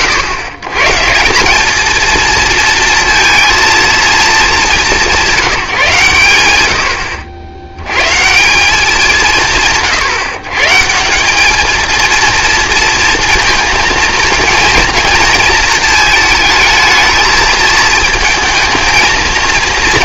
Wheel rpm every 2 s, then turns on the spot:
110, 230, 190, 80, 180, 150, 230, 230, 220, 220.
none